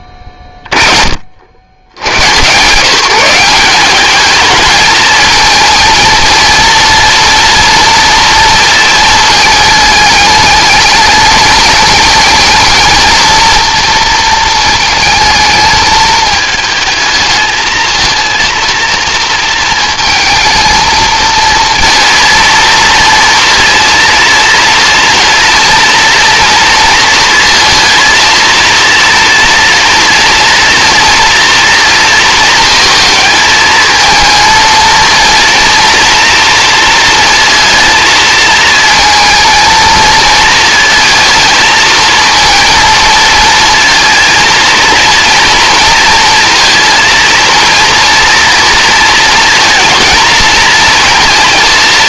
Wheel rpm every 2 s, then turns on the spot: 30, 150, 220, 230, 230, 210, 220, 220, 220, 230, 220, 230, 230, 230, 230, 230, 220, 220, 230, 230, 220, 230, 230, 230, 230, 230.
none